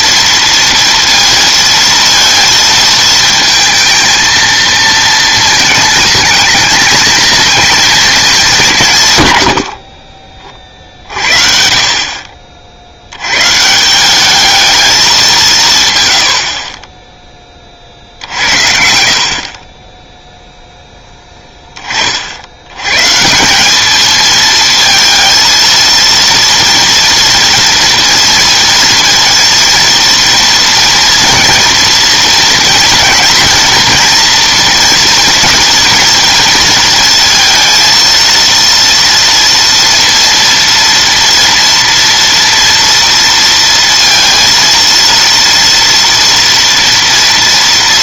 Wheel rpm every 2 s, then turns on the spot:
230, 230, 230, 220, 190, 40, 50, 210, 40, 70, 0, 80, 220, 230, 230, 230, 230, 230, 230, 230, 240, 230, 230, 230.
18-20